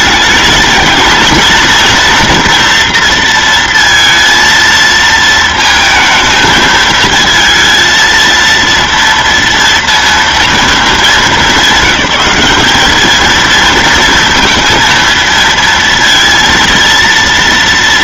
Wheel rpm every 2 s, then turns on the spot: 220, 230, 230, 220, 230, 220, 200, 230, 230.
none